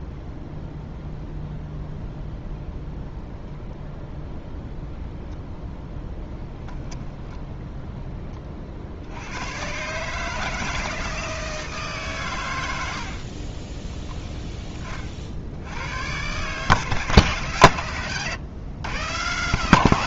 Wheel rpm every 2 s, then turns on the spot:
0, 0, 0, 0, 50, 160, 90, 30, 140, 120.
none